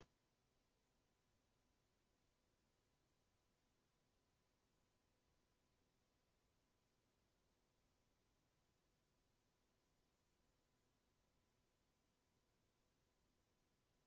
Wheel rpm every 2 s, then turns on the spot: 0, 0, 0, 0, 0, 0, 0.
none